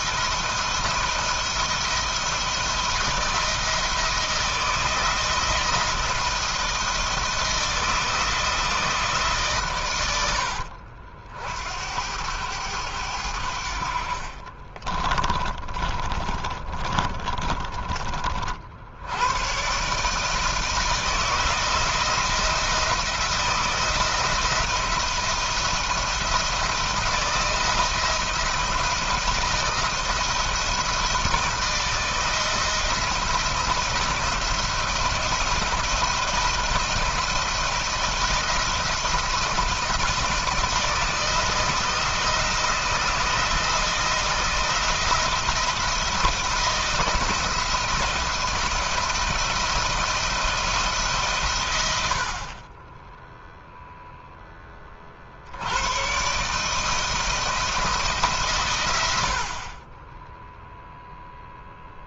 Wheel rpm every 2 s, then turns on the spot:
170, 160, 170, 160, 160, 70, 90, 30, 30, 80, 160, 170, 170, 160, 170, 160, 170, 170, 160, 170, 160, 160, 170, 160, 170, 150, 20, 40, 160, 70, 0.
14-18